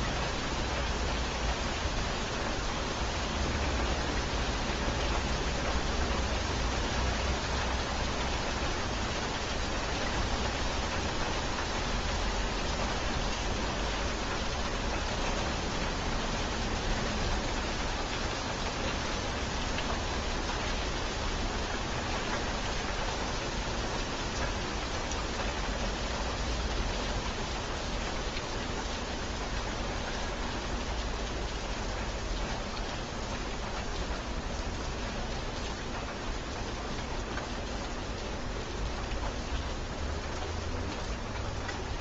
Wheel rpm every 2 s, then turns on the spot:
0, 0, 0, 0, 0, 0, 0, 0, 0, 0, 0, 0, 0, 0, 0, 0, 0, 0, 0, 0, 0.
none